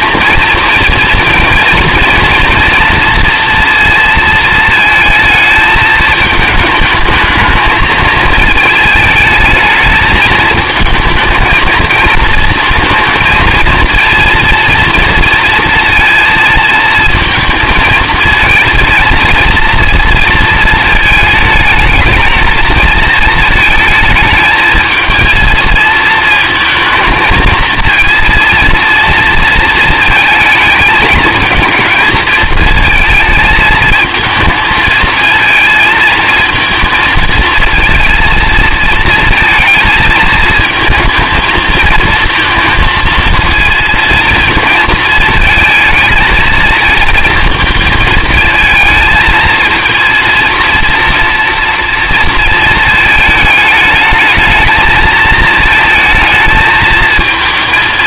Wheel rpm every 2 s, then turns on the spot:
230, 230, 220, 220, 220, 220, 230, 230, 230, 230, 220, 220, 220, 230, 230, 220, 220, 220, 230, 230, 220, 230, 230, 220, 220, 230, 220, 220, 220.
none